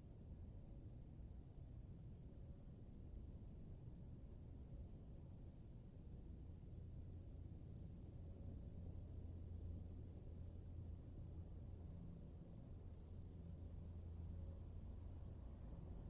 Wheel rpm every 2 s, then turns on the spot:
0, 0, 0, 0, 0, 0, 0, 0.
none